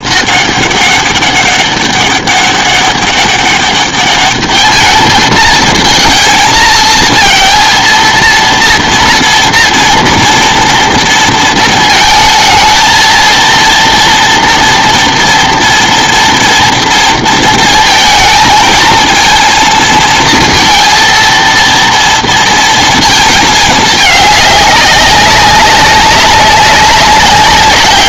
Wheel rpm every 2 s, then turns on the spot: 190, 200, 210, 220, 230, 230, 220, 230, 230, 220, 230, 230, 200, 190.
none